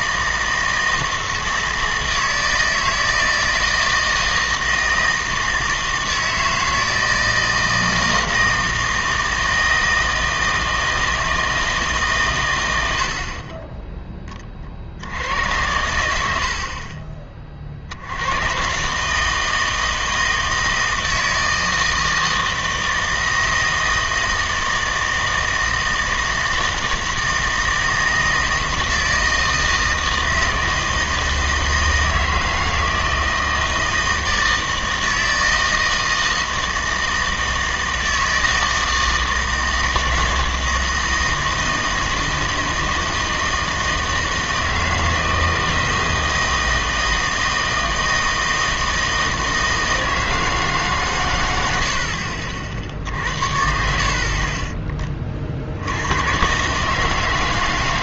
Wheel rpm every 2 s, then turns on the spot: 160, 160, 160, 160, 160, 160, 100, 50, 50, 130, 160, 160, 160, 160, 160, 160, 160, 160, 160, 160, 160, 160, 160, 160, 160, 160, 60, 30, 130.
12-14 54-56